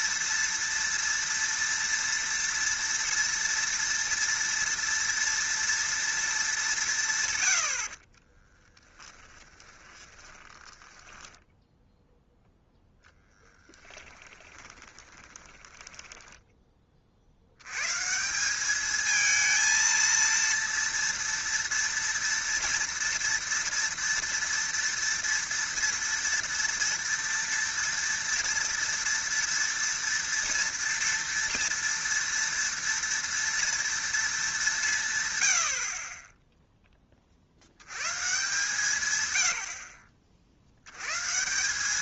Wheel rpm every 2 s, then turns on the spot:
230, 230, 230, 190, 20, 20, 0, 20, 20, 200, 230, 230, 230, 230, 230, 230, 230, 190, 10, 150, 80.
8-12 14-16